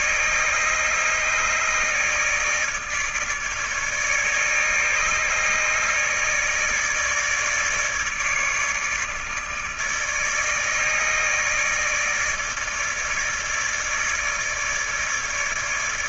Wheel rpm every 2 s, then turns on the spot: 150, 150, 150, 150, 150, 160, 160, 150.
none